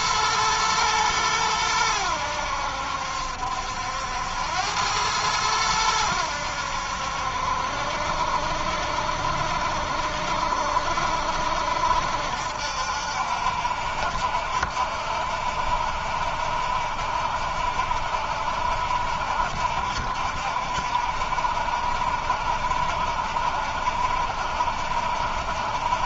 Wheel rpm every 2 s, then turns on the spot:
120, 90, 80, 90, 70, 70, 70, 70, 60, 70, 70, 70, 60.
none